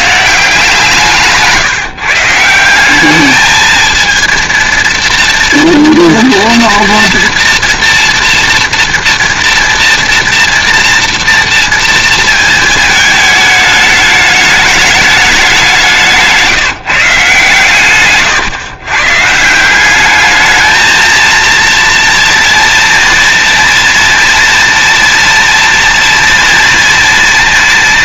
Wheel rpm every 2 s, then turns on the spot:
160, 170, 230, 230, 230, 230, 220, 210, 160, 130, 220, 230, 230, 230.
none